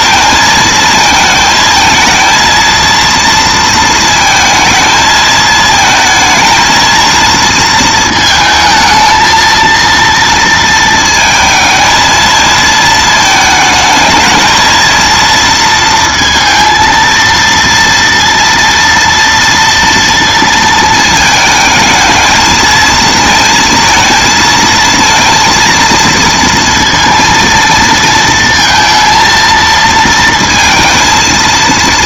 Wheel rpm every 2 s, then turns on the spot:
230, 230, 220, 230, 220, 230, 220, 220, 230, 230, 230, 230, 230, 230, 230, 230.
none